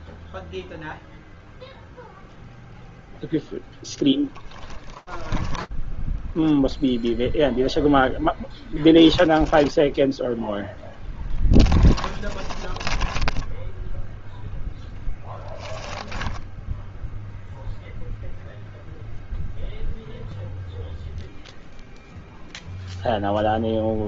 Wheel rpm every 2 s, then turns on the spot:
0, 10, 0, 10, 10, 10, 10, 0, 0, 0, 0, 10.
2-4 8-12 22-24